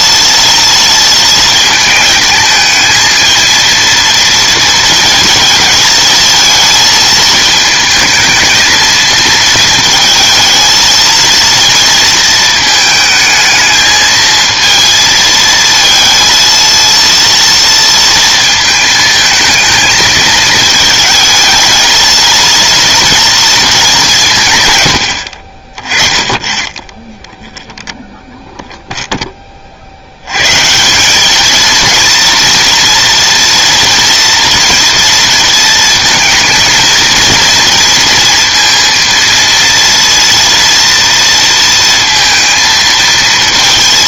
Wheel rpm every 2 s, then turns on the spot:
230, 220, 220, 220, 230, 230, 220, 230, 230, 220, 220, 230, 120, 10, 0, 150, 230, 230, 220, 230, 230, 230.
none